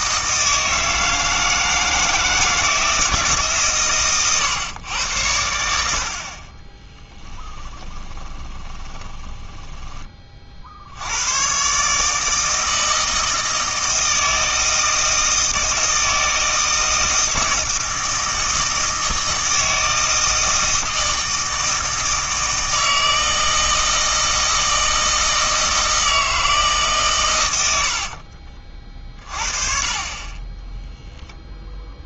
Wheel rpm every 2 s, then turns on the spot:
160, 160, 110, 20, 20, 60, 160, 160, 160, 160, 160, 160, 160, 150, 40, 10.
6-10